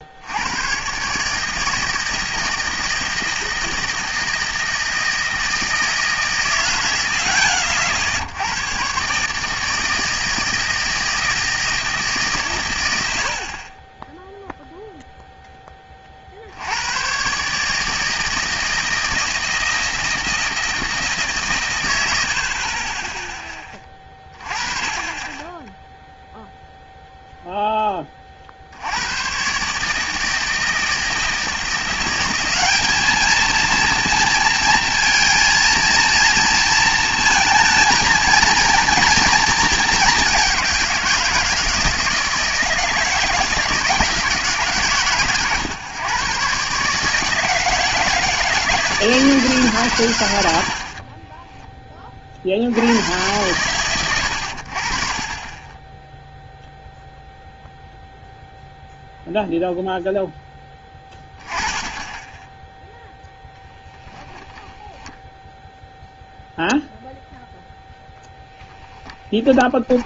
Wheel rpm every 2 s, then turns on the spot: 110, 160, 160, 110, 100, 160, 120, 0, 70, 160, 160, 40, 20, 0, 50, 160, 200, 230, 230, 220, 190, 160, 150, 140, 160, 80, 70, 70, 0, 0, 10, 10, 10, 0, 10.
none